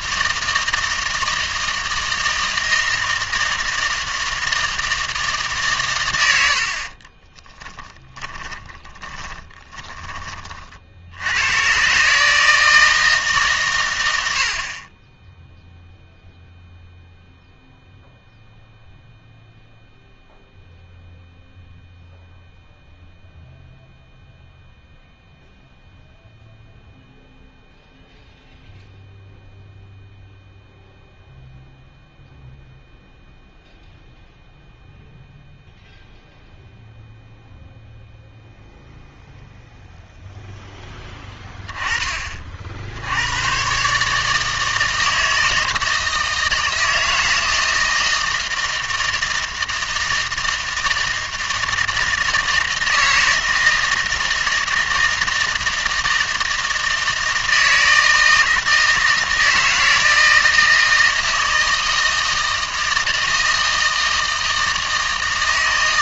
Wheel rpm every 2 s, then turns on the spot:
160, 160, 160, 60, 20, 50, 160, 50, 0, 0, 0, 0, 0, 0, 0, 0, 0, 0, 0, 0, 0, 50, 160, 160, 160, 160, 160, 160, 160, 160, 160, 160, 160.
8-10